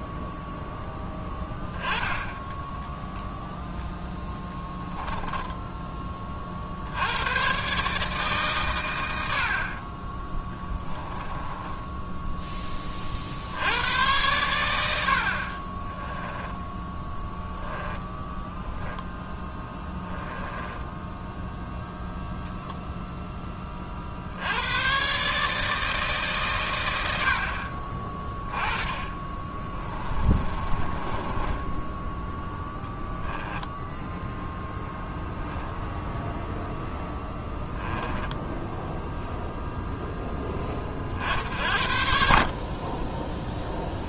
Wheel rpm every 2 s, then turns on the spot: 0, 10, 10, 60, 130, 10, 20, 70, 10, 10, 10, 0, 100, 120, 10, 30, 10, 0, 0, 10, 20, 40.
2-6 10-12 16-22 30-32